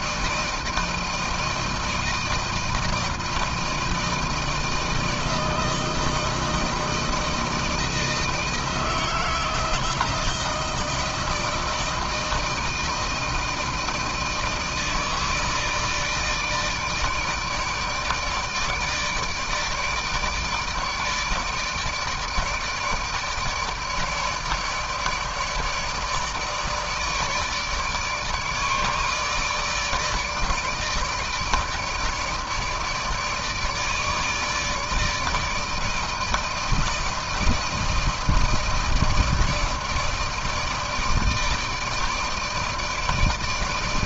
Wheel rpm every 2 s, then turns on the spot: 160, 160, 160, 160, 160, 160, 160, 160, 160, 160, 160, 150, 150, 150, 150, 150, 150, 150, 160, 160, 160, 160.
none